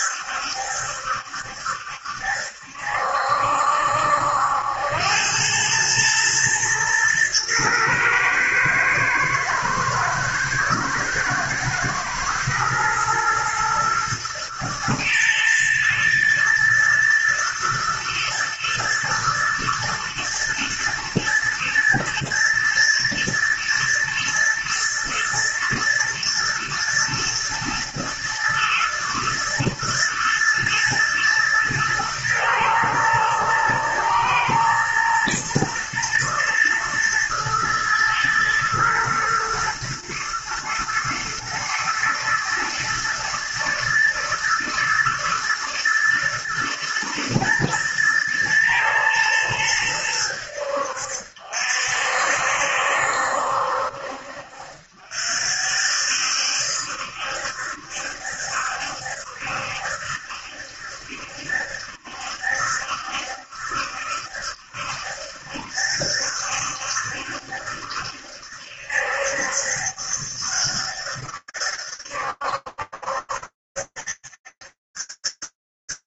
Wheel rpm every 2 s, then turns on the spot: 70, 70, 80, 110, 110, 110, 110, 120, 110, 110, 120, 110, 110, 120, 110, 120, 120, 120, 120, 110, 120, 120, 110, 120, 120, 80, 60, 60, 70, 70, 70, 70, 70, 70, 70, 70, 70, 70.
none